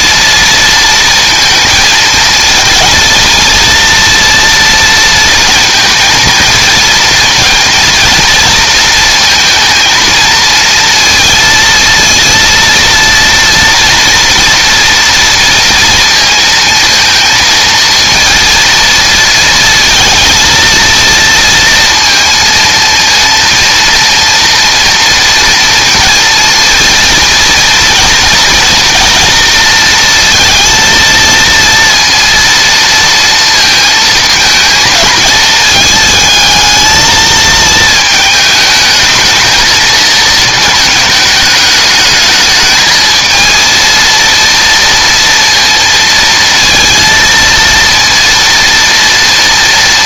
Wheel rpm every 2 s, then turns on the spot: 230, 230, 230, 230, 230, 230, 230, 230, 220, 230, 230, 230, 230, 230, 230, 230, 230, 220, 220, 230, 210, 230, 230, 230, 230.
none